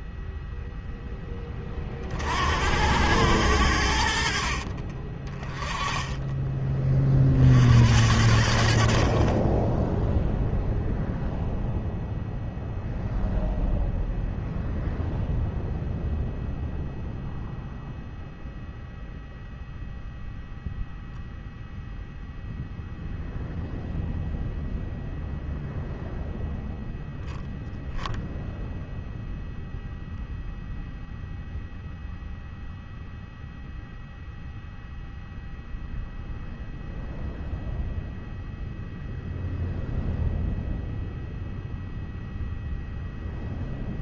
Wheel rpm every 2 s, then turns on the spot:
0, 60, 40, 20, 60, 0, 0, 0, 0, 0, 0, 0, 0, 0, 0, 0, 0, 0, 0, 0, 0, 0.
4-6